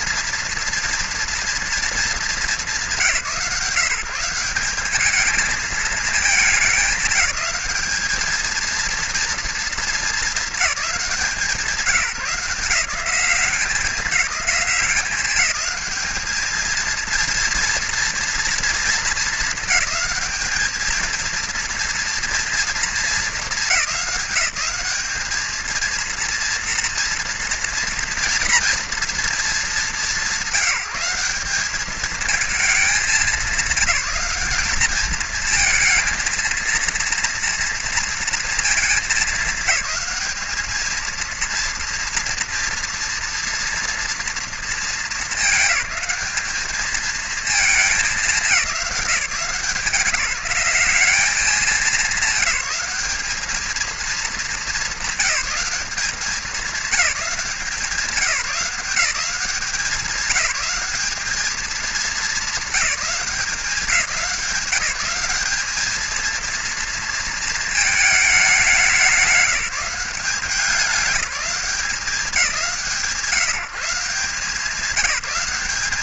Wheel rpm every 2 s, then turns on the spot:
230, 180, 200, 210, 230, 190, 190, 200, 230, 220, 220, 220, 210, 230, 220, 190, 200, 220, 230, 220, 220, 230, 220, 230, 190, 190, 200, 190, 200, 170, 200, 190, 170, 230, 180, 200, 160, 180.
none